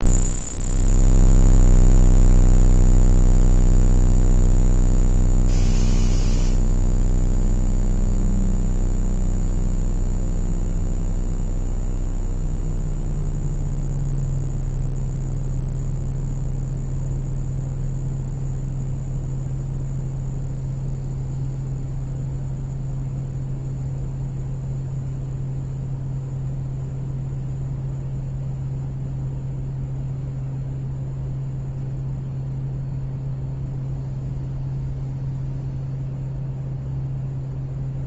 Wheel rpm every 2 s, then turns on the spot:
0, 0, 0, 0, 0, 0, 0, 0, 0, 0, 0, 0, 0, 0, 0, 0, 0, 0, 0.
none